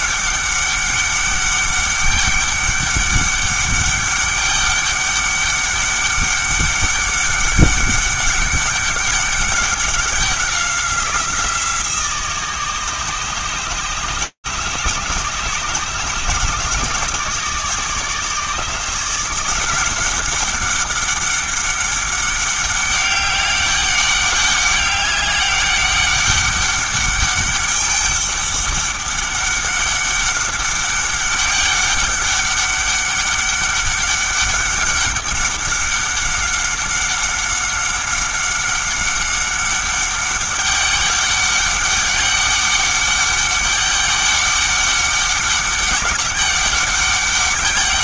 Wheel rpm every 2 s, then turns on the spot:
200, 200, 200, 200, 200, 180, 160, 150, 150, 160, 200, 200, 200, 200, 200, 200, 200, 200, 190, 190, 200, 200, 200, 200.
none